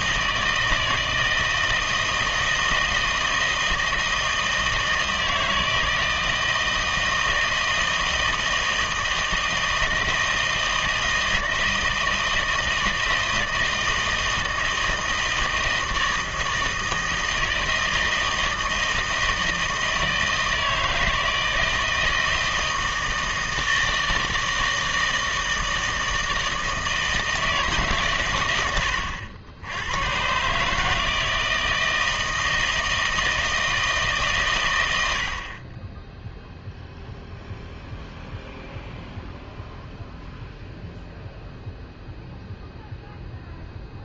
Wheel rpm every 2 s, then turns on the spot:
160, 160, 160, 160, 160, 160, 160, 160, 160, 160, 160, 160, 160, 160, 90, 150, 160, 120, 0, 0, 0, 0.
none